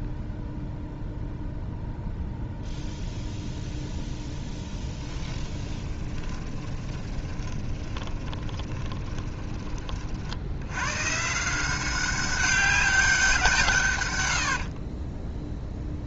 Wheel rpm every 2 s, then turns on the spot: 0, 0, 10, 20, 10, 100, 200, 50.
4-10 14-16